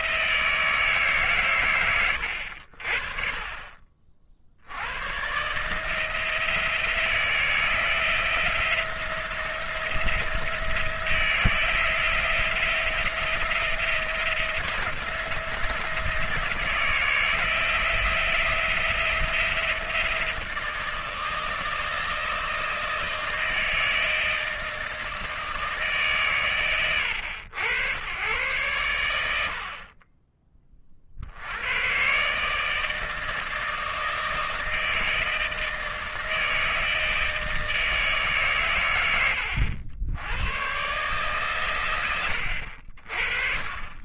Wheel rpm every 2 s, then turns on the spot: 120, 30, 140, 160, 170, 170, 170, 170, 170, 170, 160, 160, 150, 90, 60, 70, 160, 160, 160, 100, 130, 30.
none